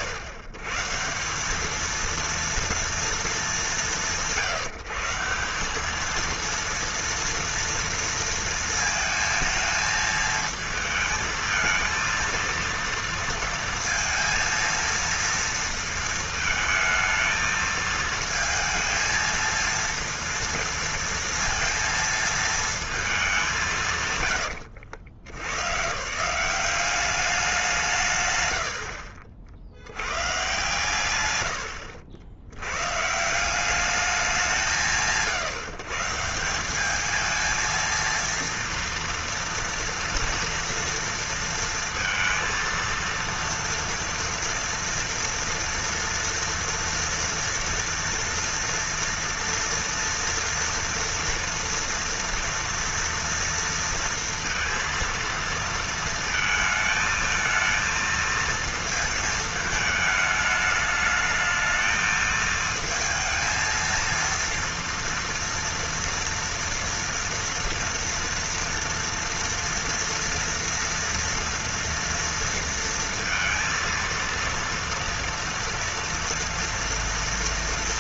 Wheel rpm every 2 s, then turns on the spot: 120, 230, 170, 230, 230, 220, 230, 230, 220, 220, 230, 220, 120, 190, 80, 130, 120, 140, 200, 230, 230, 230, 230, 230, 240, 230, 230, 230, 220, 220, 220, 220, 230, 230, 230, 230, 230, 230, 240.
28-30